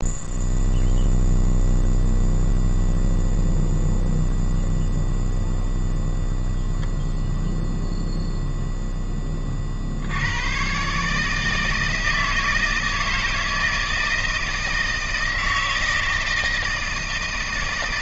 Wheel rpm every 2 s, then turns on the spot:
0, 0, 0, 0, 0, 120, 160, 160, 160.
none